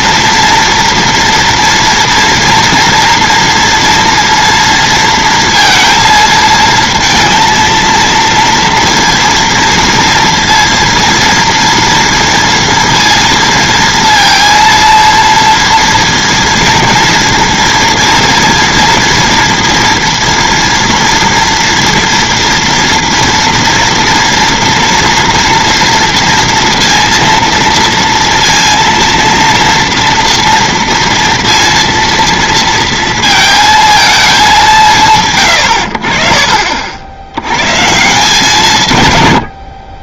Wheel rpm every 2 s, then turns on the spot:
230, 230, 230, 230, 230, 230, 230, 230, 230, 230, 230, 230, 230, 230, 230, 230, 230, 160, 50, 140.
none